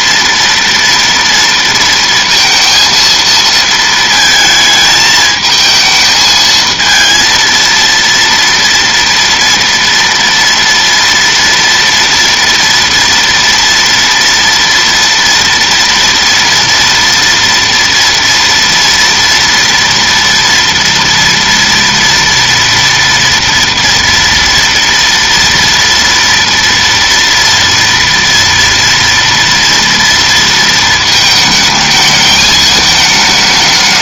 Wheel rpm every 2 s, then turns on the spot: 230, 230, 220, 220, 230, 230, 230, 230, 230, 230, 230, 230, 230, 230, 230, 230, 220.
none